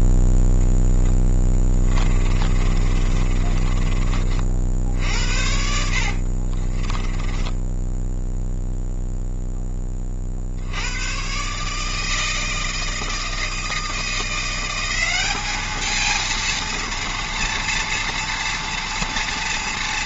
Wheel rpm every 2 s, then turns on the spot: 10, 30, 50, 30, 0, 80, 160, 180, 230, 240.
2-4 6-8